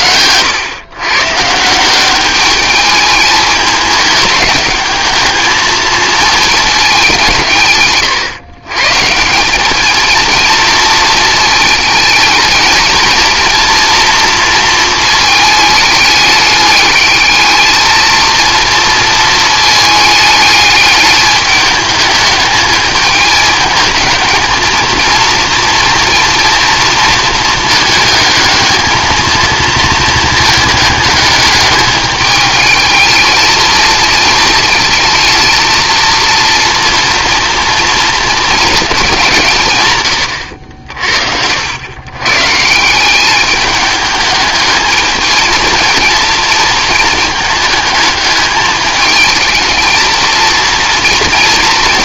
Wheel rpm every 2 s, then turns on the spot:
130, 210, 210, 220, 150, 230, 220, 230, 210, 230, 210, 220, 220, 230, 220, 220, 220, 230, 230, 230, 80, 160, 220, 230, 220, 230.
none